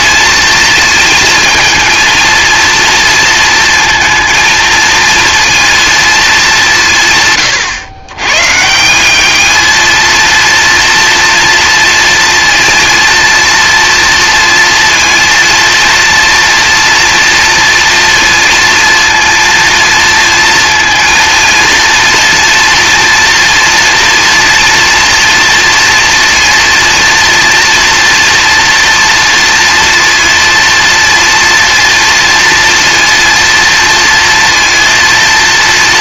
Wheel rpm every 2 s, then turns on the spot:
220, 230, 230, 190, 160, 230, 230, 230, 240, 230, 230, 230, 230, 230, 230, 230, 230, 230.
none